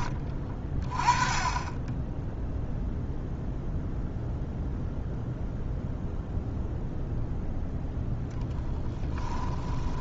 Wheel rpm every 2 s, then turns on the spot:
30, 0, 0, 0, 20.
0-2 8-10